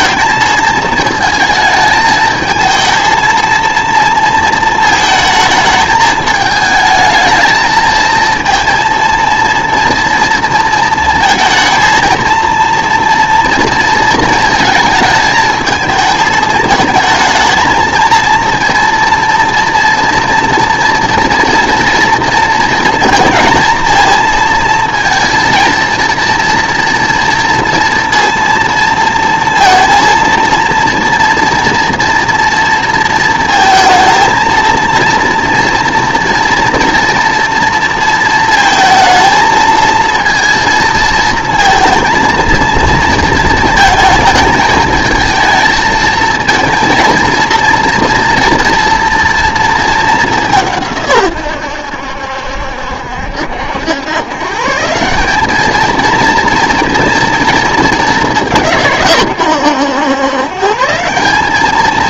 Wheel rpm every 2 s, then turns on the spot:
220, 220, 220, 210, 230, 230, 230, 220, 220, 230, 230, 230, 230, 230, 230, 230, 230, 230, 230, 220, 230, 230, 220, 230, 230, 170, 70, 150, 230, 180, 140.
none